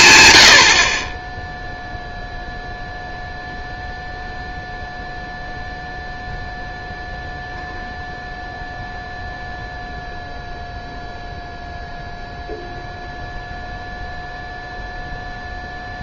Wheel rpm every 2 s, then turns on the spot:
90, 0, 0, 0, 0, 0, 0, 0.
none